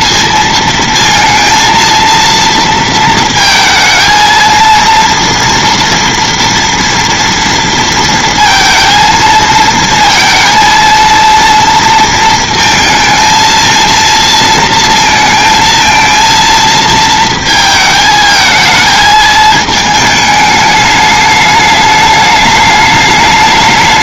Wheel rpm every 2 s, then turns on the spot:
230, 230, 230, 230, 230, 230, 220, 230, 230, 220, 210, 210.
none